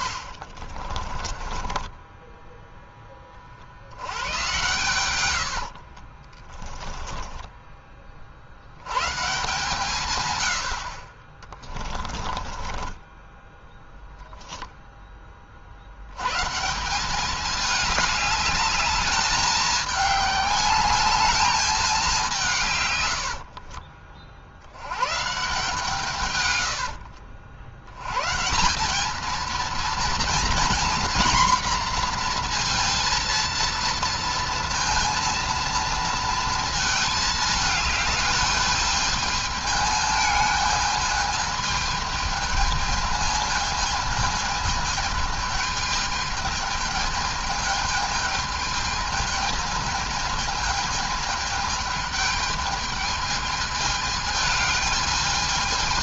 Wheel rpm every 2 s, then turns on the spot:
50, 10, 110, 20, 70, 70, 20, 10, 160, 210, 200, 130, 90, 80, 180, 240, 230, 230, 220, 220, 220, 220, 220, 220, 220, 220, 210, 220.
0-2 6-8 12-14 26-28